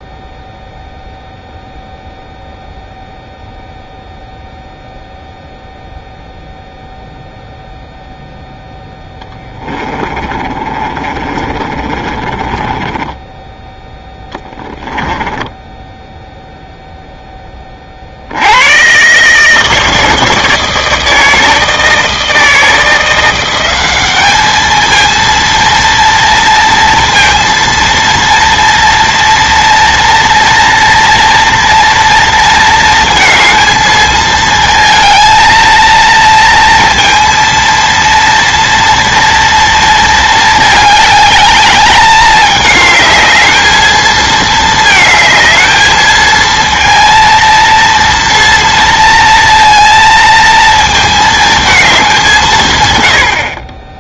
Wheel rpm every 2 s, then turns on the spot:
0, 0, 0, 0, 0, 30, 20, 10, 0, 100, 160, 160, 220, 230, 230, 230, 230, 230, 230, 230, 210, 210, 220, 230, 230, 230, 140.
10-16